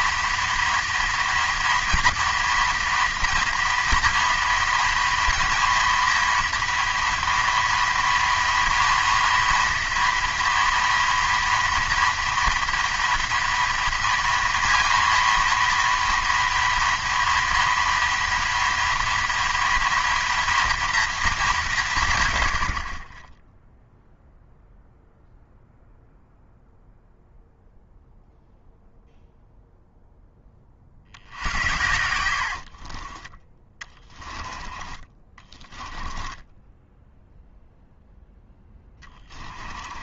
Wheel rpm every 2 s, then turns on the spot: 230, 230, 230, 240, 240, 230, 230, 230, 240, 230, 240, 70, 0, 0, 0, 30, 60, 20, 10, 20.
32-34 36-40